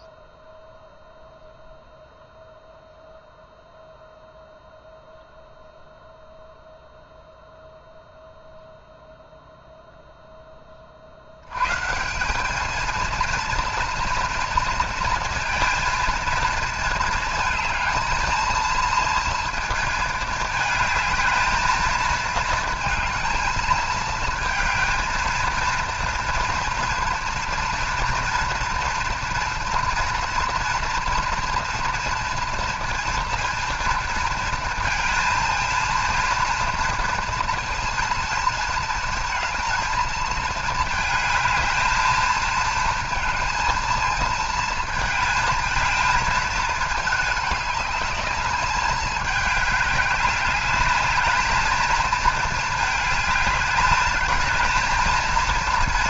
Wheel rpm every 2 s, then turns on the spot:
0, 0, 0, 0, 0, 20, 210, 230, 220, 230, 220, 230, 220, 230, 230, 230, 230, 230, 230, 230, 220, 220, 220, 220, 210, 210, 220, 220.
none